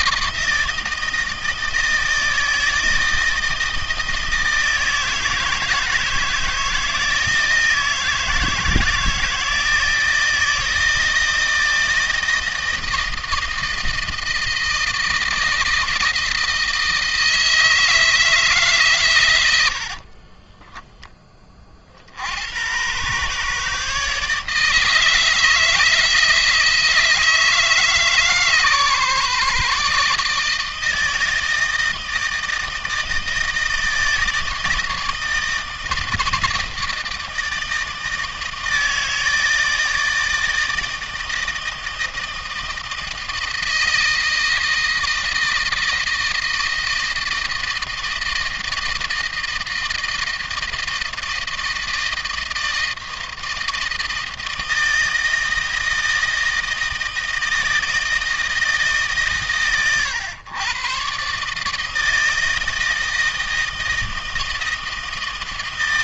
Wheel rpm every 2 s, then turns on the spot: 160, 160, 160, 160, 160, 160, 160, 160, 160, 130, 10, 120, 160, 160, 140, 160, 160, 160, 160, 160, 160, 160, 160, 160, 160, 160, 160, 160, 160, 150, 130, 160, 160.
none